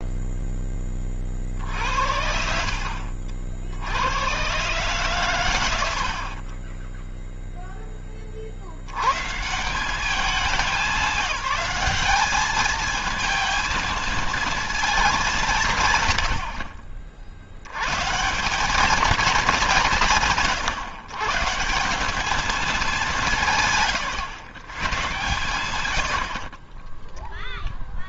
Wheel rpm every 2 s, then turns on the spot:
20, 50, 130, 20, 70, 200, 220, 220, 60, 200, 130, 210, 120, 20.
6-8 26-28